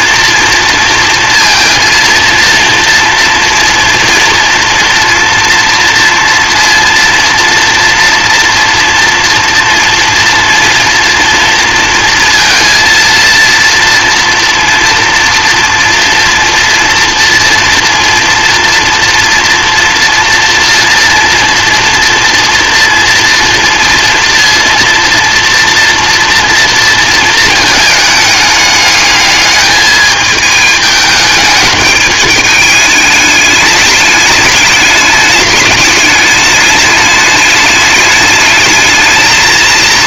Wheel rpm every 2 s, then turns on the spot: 230, 230, 230, 230, 230, 230, 230, 230, 230, 240, 230, 230, 230, 230, 210, 210, 210, 210, 210, 220.
none